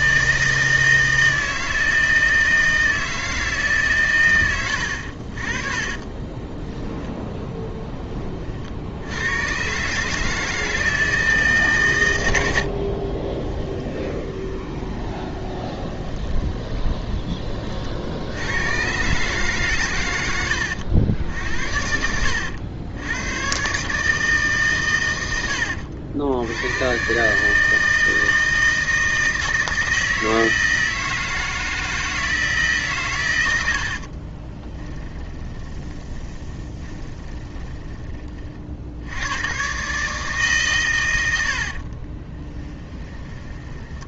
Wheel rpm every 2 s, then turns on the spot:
160, 90, 10, 50, 160, 90, 20, 20, 80, 100, 90, 150, 80, 160, 160, 160, 60, 20, 20, 120, 70, 30.
4-6 12-16 32-38